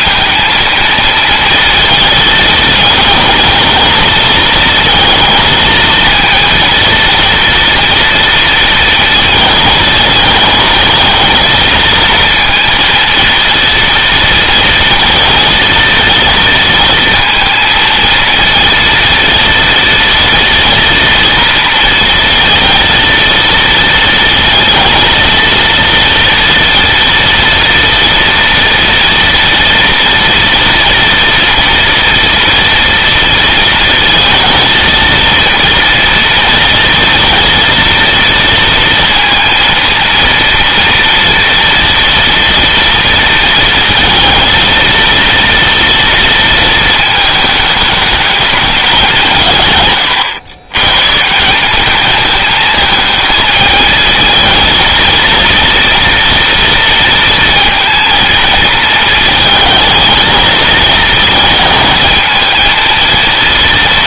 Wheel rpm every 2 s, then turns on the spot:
230, 220, 230, 230, 230, 230, 230, 230, 230, 230, 230, 230, 230, 230, 230, 230, 230, 230, 230, 230, 230, 230, 230, 220, 180, 140, 220, 230, 230, 220, 220, 230.
none